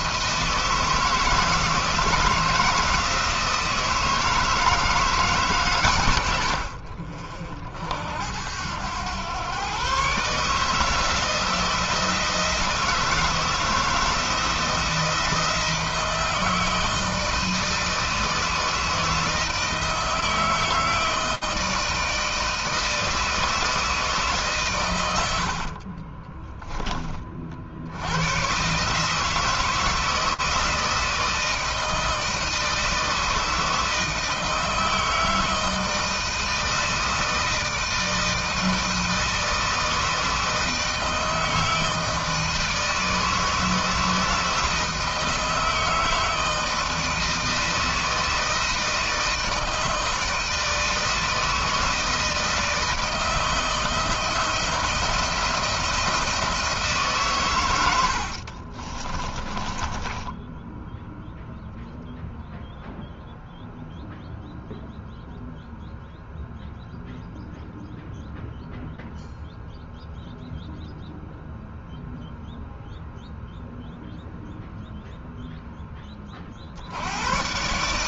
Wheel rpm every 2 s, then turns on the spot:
160, 160, 160, 50, 100, 160, 160, 160, 160, 160, 160, 160, 110, 20, 140, 160, 160, 160, 160, 160, 160, 160, 160, 160, 160, 160, 160, 170, 150, 30, 0, 0, 0, 0, 0, 0, 0, 0, 80.
58-60